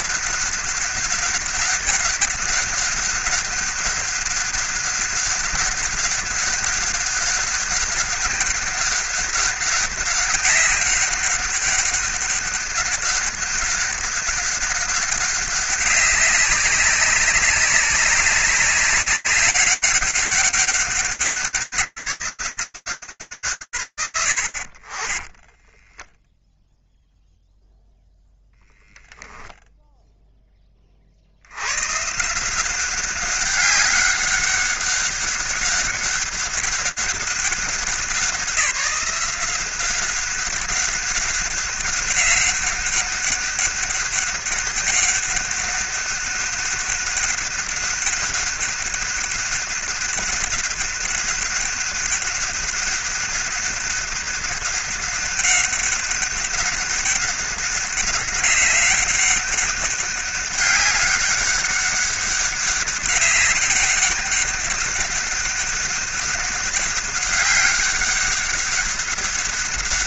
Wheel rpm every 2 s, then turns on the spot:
200, 200, 200, 200, 200, 200, 190, 200, 200, 200, 190, 180, 80, 0, 0, 20, 180, 200, 200, 190, 190, 200, 200, 200, 200, 200, 190, 200, 200, 200, 200, 200, 190, 200, 200.
none